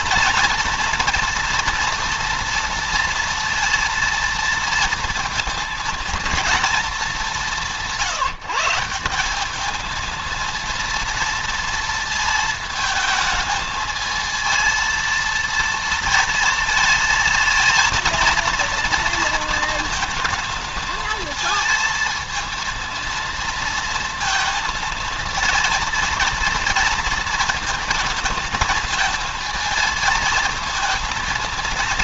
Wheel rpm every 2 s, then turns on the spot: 240, 230, 230, 220, 170, 230, 220, 230, 230, 230, 230, 230, 230, 230, 230, 220.
none